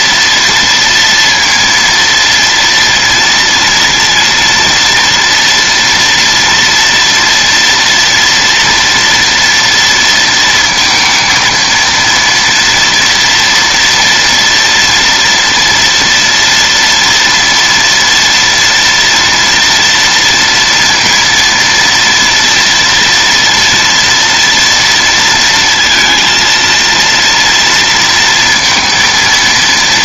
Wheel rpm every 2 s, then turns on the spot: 240, 230, 230, 230, 230, 230, 230, 230, 230, 230, 230, 230, 230, 230, 230.
none